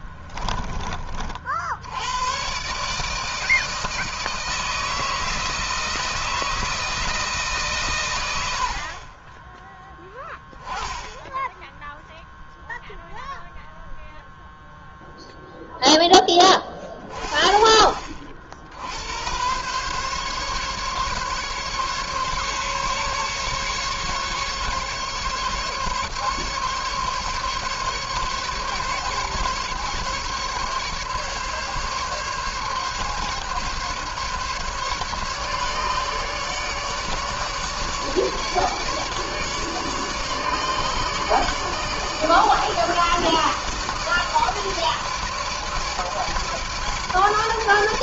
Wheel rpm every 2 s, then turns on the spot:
30, 150, 160, 160, 40, 10, 0, 0, 40, 80, 140, 140, 140, 140, 140, 140, 140, 150, 150, 150, 150, 150, 150, 150.
none